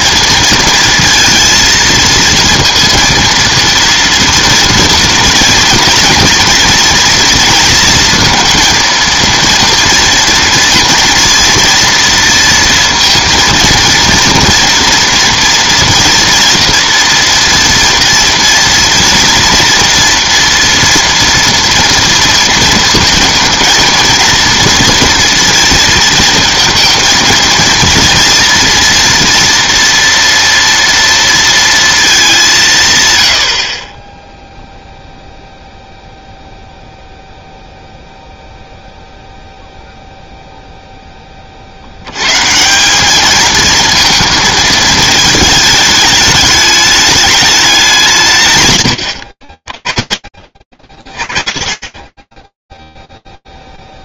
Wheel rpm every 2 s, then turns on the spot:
230, 230, 230, 230, 230, 240, 230, 230, 240, 230, 230, 230, 230, 220, 230, 230, 120, 0, 0, 0, 0, 180, 220, 210, 130, 40, 10.
none